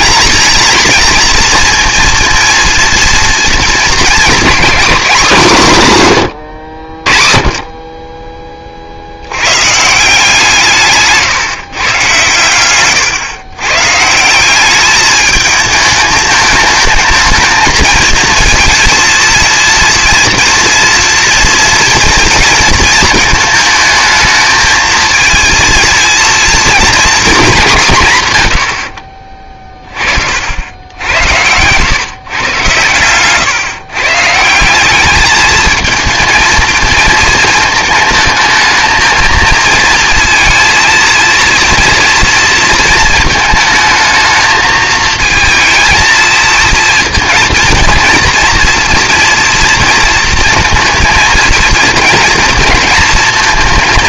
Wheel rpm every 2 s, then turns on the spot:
220, 230, 240, 80, 40, 150, 120, 200, 220, 230, 230, 220, 220, 230, 80, 70, 110, 180, 230, 220, 230, 230, 220, 230, 230, 230, 230.
none